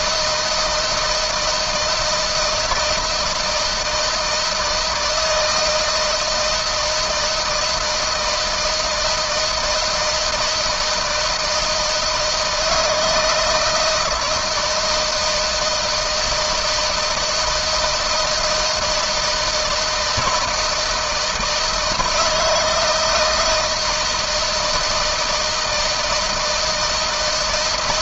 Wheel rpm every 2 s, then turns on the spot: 160, 160, 160, 160, 160, 160, 160, 160, 160, 170, 160, 160, 160, 160.
none